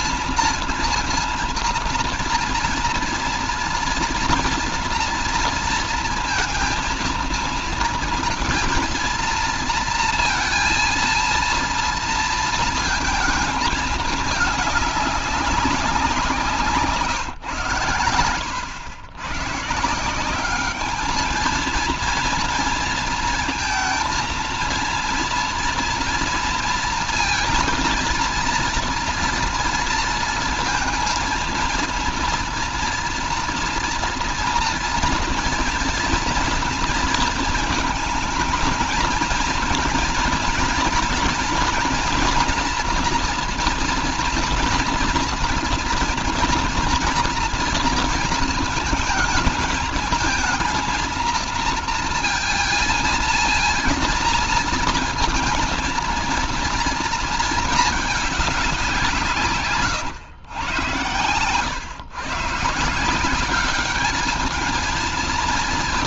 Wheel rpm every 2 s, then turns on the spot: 230, 230, 230, 230, 230, 230, 230, 210, 170, 100, 200, 230, 230, 230, 230, 230, 230, 240, 230, 220, 230, 230, 230, 230, 220, 220, 230, 230, 230, 200, 110, 150, 220.
16-18